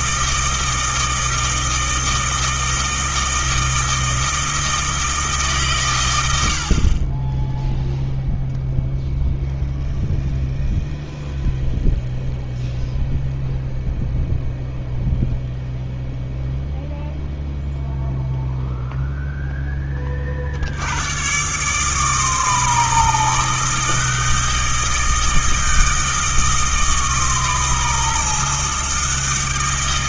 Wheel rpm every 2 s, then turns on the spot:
160, 160, 160, 40, 0, 0, 0, 0, 0, 0, 90, 160, 160, 160, 160.
none